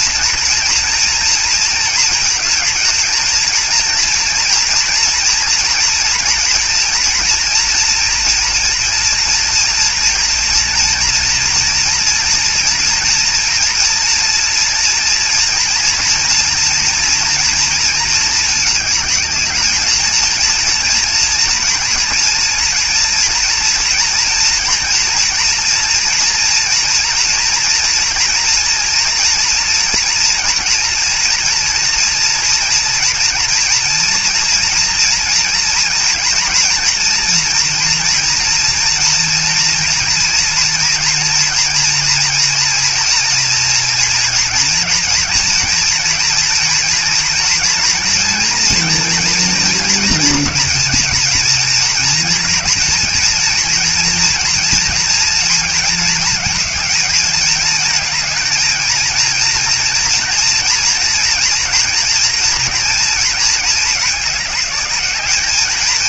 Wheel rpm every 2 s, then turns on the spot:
230, 220, 230, 230, 230, 230, 230, 240, 240, 220, 230, 230, 230, 230, 240, 230, 230, 230, 230, 230, 230, 230, 230, 230, 230, 230, 230, 230, 220, 230, 230, 230, 210.
none